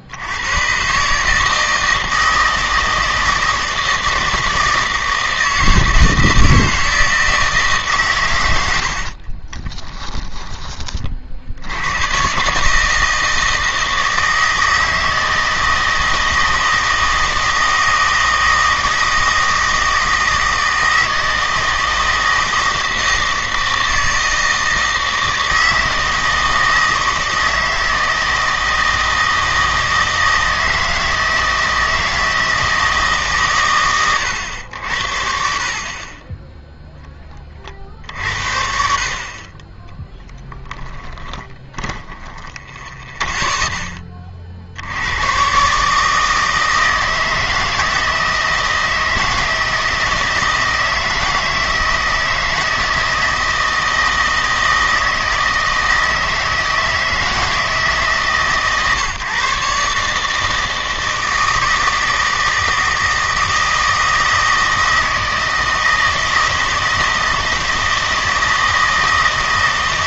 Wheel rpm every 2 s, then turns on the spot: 130, 160, 160, 160, 80, 30, 150, 160, 160, 160, 160, 160, 160, 160, 160, 160, 160, 80, 0, 60, 20, 10, 70, 160, 160, 160, 160, 160, 160, 140, 160, 160, 160, 160, 160.
40-42